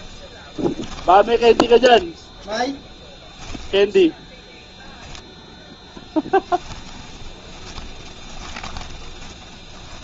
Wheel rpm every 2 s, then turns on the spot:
20, 0, 0, 10, 20.
0-2 6-10